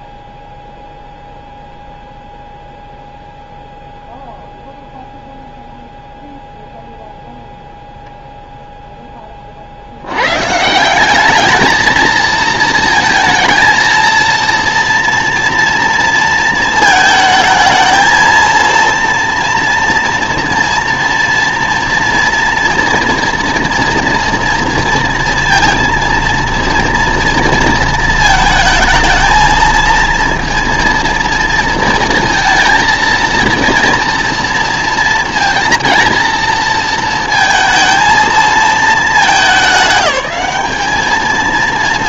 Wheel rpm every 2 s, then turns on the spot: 0, 0, 0, 0, 0, 160, 220, 230, 230, 230, 230, 240, 230, 230, 220, 230, 230, 230, 230, 220, 200.
none